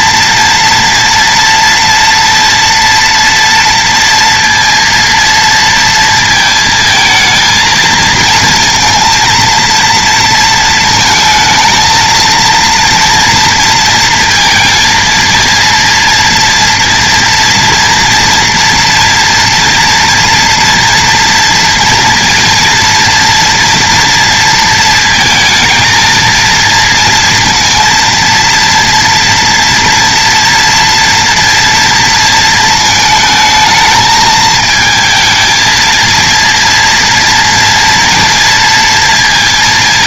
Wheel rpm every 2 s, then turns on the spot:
230, 230, 230, 220, 230, 230, 230, 230, 230, 230, 230, 240, 230, 230, 240, 230, 220, 220, 230, 230.
none